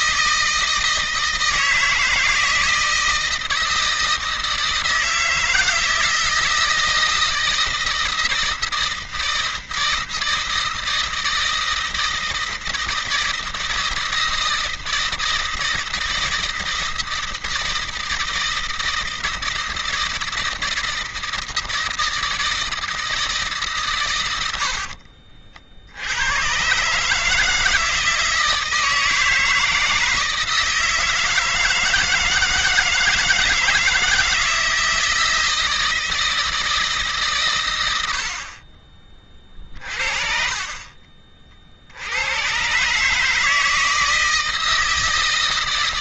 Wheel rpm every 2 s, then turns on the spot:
160, 160, 160, 160, 160, 160, 160, 160, 160, 160, 160, 160, 80, 130, 160, 160, 160, 160, 160, 50, 30, 110, 160.
24-26